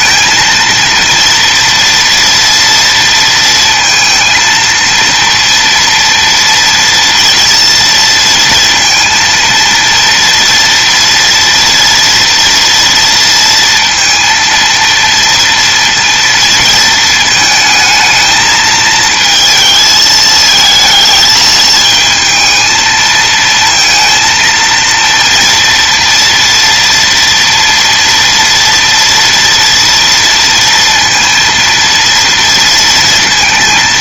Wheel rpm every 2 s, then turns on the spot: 230, 230, 230, 230, 230, 230, 230, 230, 220, 220, 220, 220, 230, 240, 230, 230, 230.
none